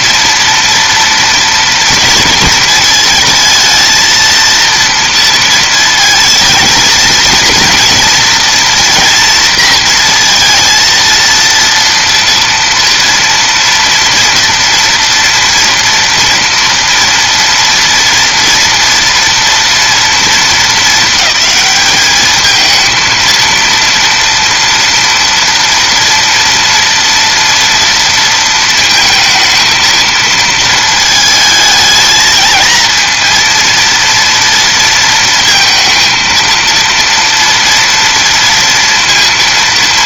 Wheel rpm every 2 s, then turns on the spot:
230, 220, 230, 220, 230, 230, 230, 240, 230, 240, 220, 220, 230, 230, 230, 230, 230, 230, 230, 230.
none